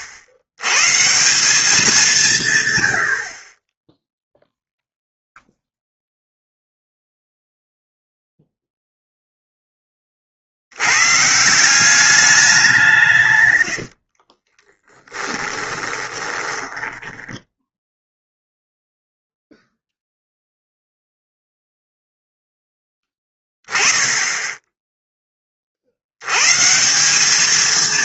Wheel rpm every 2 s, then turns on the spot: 110, 150, 0, 0, 0, 80, 180, 20, 10, 0, 0, 10, 10, 140.
14-18